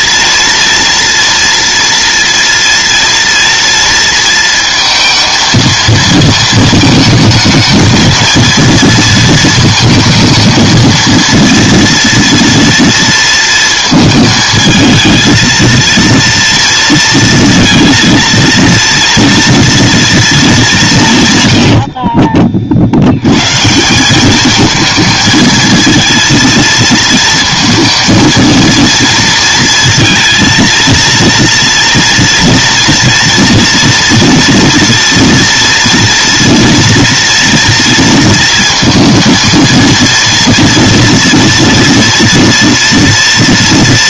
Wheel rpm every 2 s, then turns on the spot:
240, 230, 230, 220, 230, 230, 230, 220, 230, 230, 200, 30, 210, 230, 230, 230, 230, 230, 230, 230, 240, 240.
none